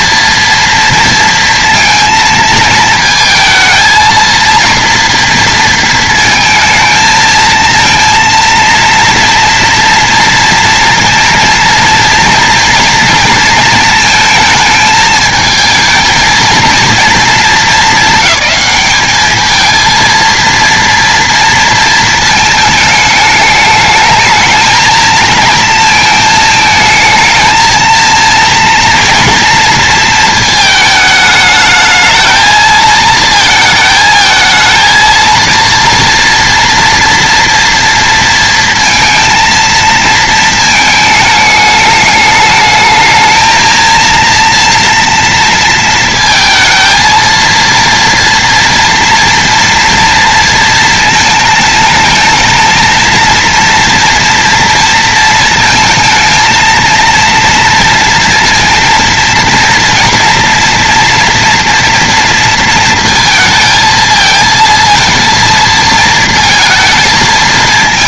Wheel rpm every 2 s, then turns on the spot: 230, 230, 230, 230, 230, 230, 230, 220, 220, 200, 230, 220, 220, 220, 230, 230, 220, 220, 230, 230, 220, 220, 230, 230, 230, 230, 220, 230, 220, 230, 230, 230, 230, 230.
none